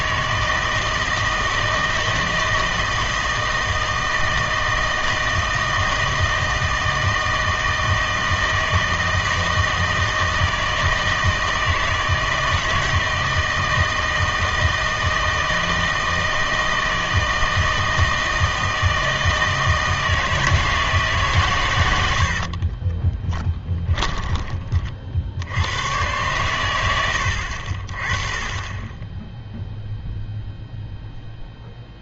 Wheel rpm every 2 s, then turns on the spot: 160, 160, 160, 160, 160, 160, 160, 160, 160, 160, 160, 40, 30, 100, 20, 0.
22-24